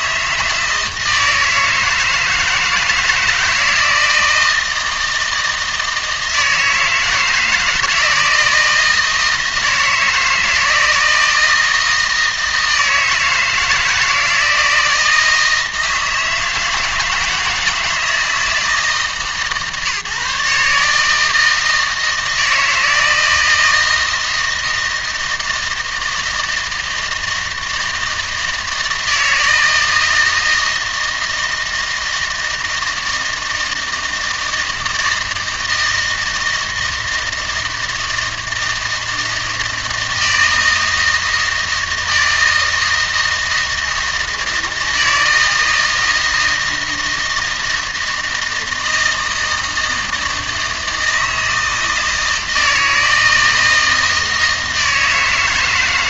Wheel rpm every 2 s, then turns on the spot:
160, 160, 160, 160, 170, 160, 160, 170, 160, 160, 150, 160, 160, 160, 160, 160, 160, 160, 160, 160, 160, 160, 160, 160, 160, 160, 160, 160.
none